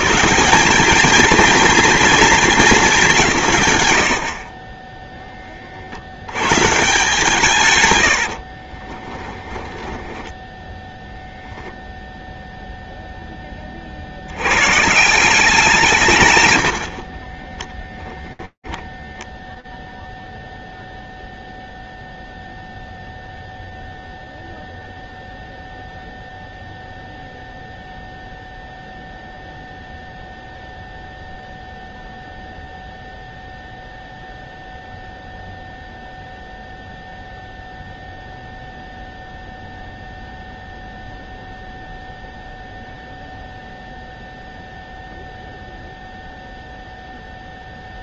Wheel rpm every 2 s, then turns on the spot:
200, 190, 20, 150, 20, 10, 0, 140, 50, 0, 0, 0, 0, 0, 0, 0, 0, 0, 0, 0, 0, 0, 0, 0.
8-10 16-18